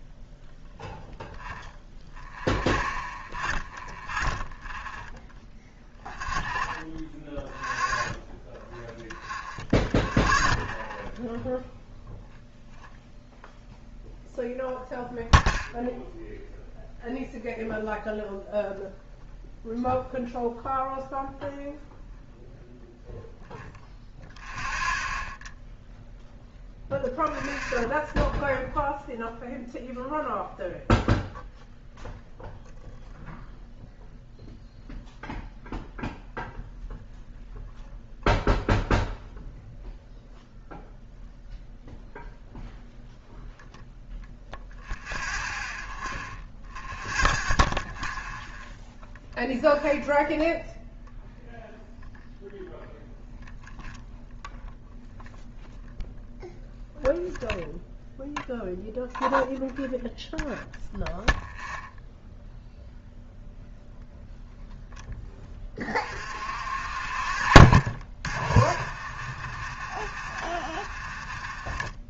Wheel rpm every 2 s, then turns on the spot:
0, 0, 0, 0, 0, 0, 0, 0, 0, 0, 0, 0, 0, 0, 0, 0, 0, 0, 0, 0, 0, 0, 0, 0, 0, 0, 0, 0, 0, 0, 0, 0, 0, 40, 40, 30.
none